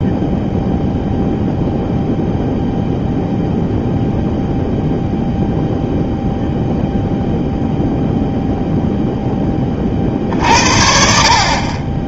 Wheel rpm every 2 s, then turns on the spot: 0, 0, 0, 0, 0, 60.
none